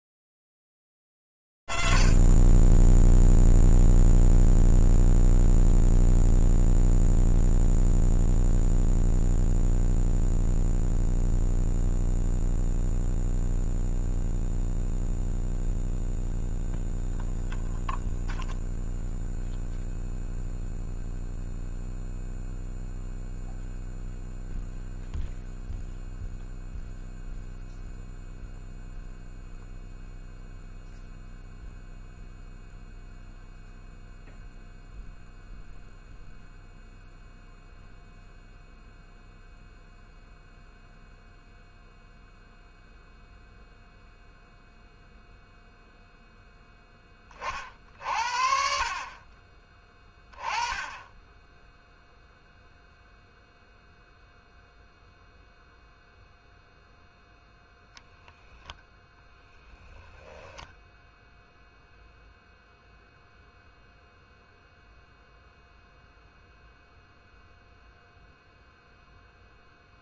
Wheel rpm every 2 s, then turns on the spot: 90, 90, 0, 0, 0, 0, 0, 0, 0, 0, 0, 0, 0, 0, 0, 0, 0, 0, 0, 0, 0, 0, 0, 0, 50, 20, 0, 0, 0, 0, 0, 0, 0, 0, 0.
none